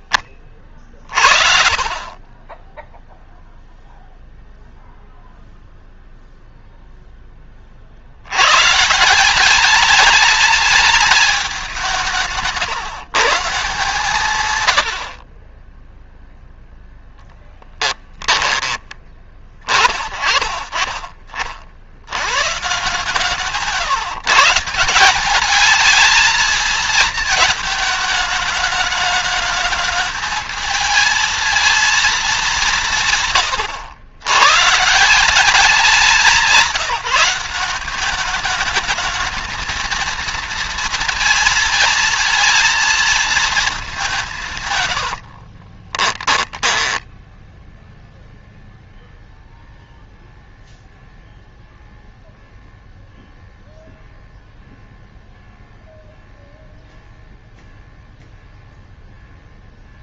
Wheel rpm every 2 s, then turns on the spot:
40, 10, 0, 0, 140, 210, 160, 90, 10, 20, 30, 130, 160, 220, 210, 220, 170, 150, 180, 210, 230, 230, 130, 10, 0, 0, 0, 0, 0, 0.
16-18 44-48